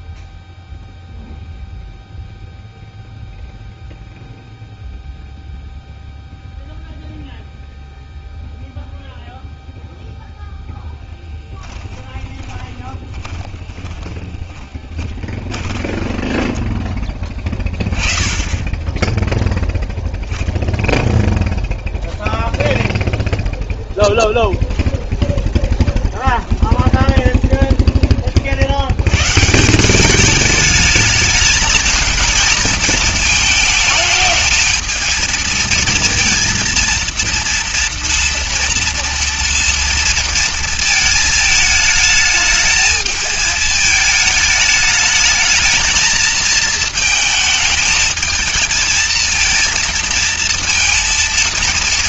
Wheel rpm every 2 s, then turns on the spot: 0, 0, 0, 0, 0, 0, 20, 20, 10, 20, 0, 0, 10, 30, 60, 210, 220, 220, 230, 230, 230, 220, 210, 230, 220, 230.
12-18 24-28